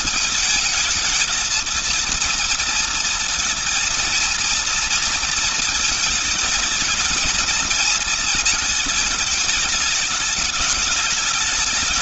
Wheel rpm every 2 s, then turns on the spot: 220, 230, 230, 220, 220, 210.
none